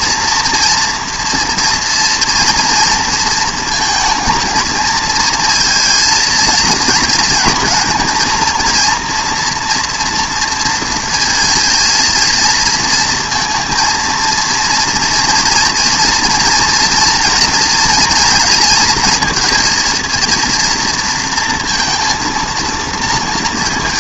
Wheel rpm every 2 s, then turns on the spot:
230, 230, 220, 220, 230, 230, 230, 230, 230, 230, 230, 230.
none